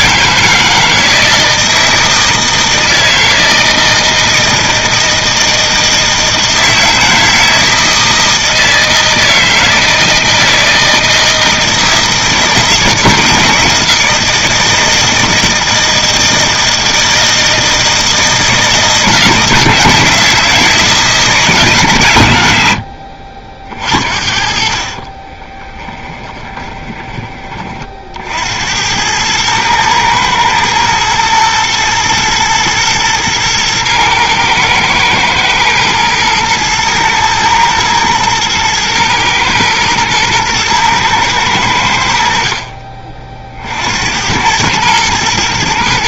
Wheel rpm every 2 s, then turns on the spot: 160, 160, 160, 160, 160, 160, 160, 160, 160, 160, 160, 80, 50, 20, 90, 110, 110, 110, 110, 110, 110, 50, 100.
24-28